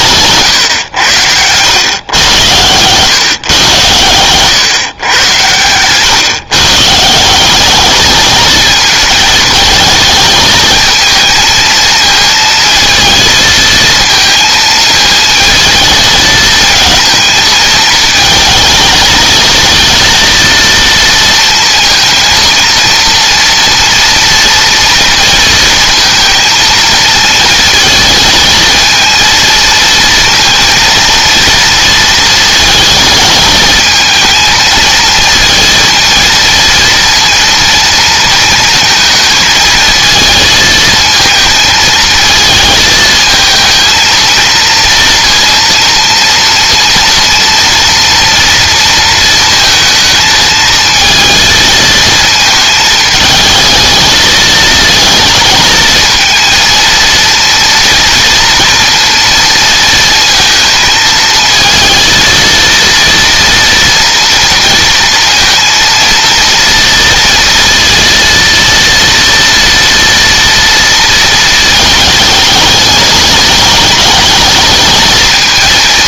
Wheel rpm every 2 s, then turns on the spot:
90, 110, 110, 160, 230, 220, 230, 220, 220, 230, 230, 230, 230, 220, 230, 230, 220, 230, 230, 220, 220, 220, 230, 230, 230, 230, 220, 220, 230, 230, 220, 230, 230, 230, 230, 230, 210, 220.
none